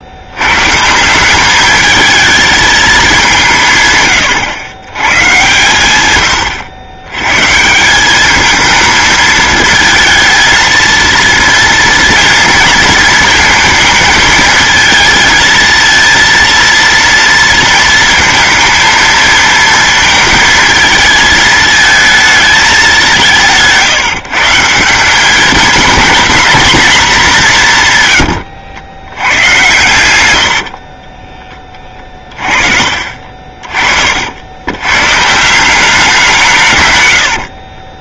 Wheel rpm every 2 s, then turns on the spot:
160, 200, 110, 90, 220, 220, 230, 220, 230, 220, 220, 190, 190, 220, 70, 30, 40, 130, 80.
30-34 36-38